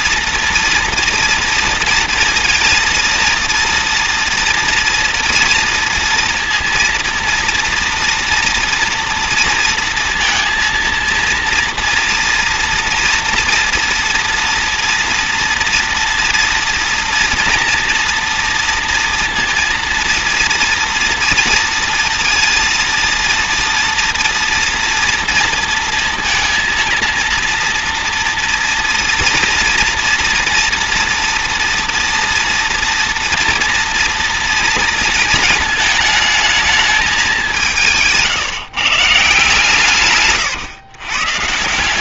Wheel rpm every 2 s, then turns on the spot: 230, 230, 230, 230, 230, 230, 230, 230, 240, 230, 230, 230, 230, 230, 230, 240, 230, 220, 200, 160, 130.
none